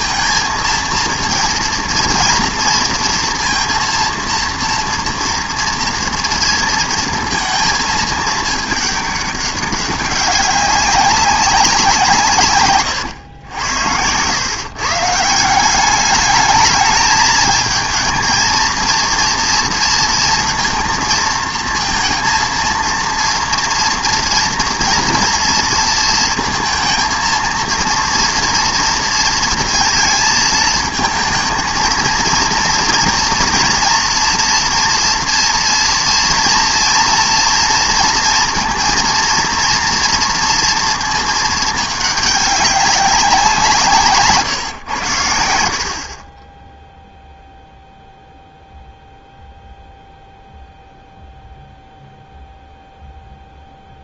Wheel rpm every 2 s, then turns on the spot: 230, 230, 230, 230, 210, 200, 130, 130, 210, 230, 230, 230, 240, 220, 230, 220, 230, 240, 230, 230, 230, 200, 130, 10, 0, 0, 0.
none